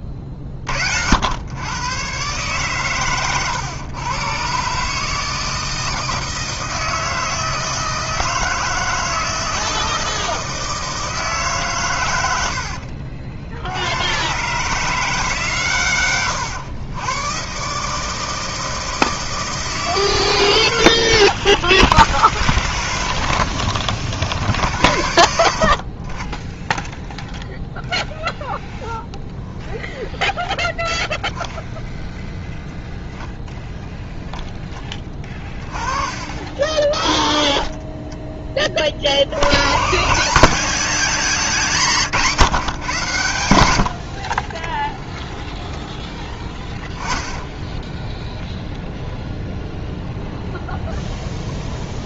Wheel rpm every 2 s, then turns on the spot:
70, 130, 140, 160, 160, 160, 70, 150, 120, 160, 40, 10, 80, 0, 0, 0, 0, 20, 30, 80, 210, 90, 0, 20, 0, 0.
46-48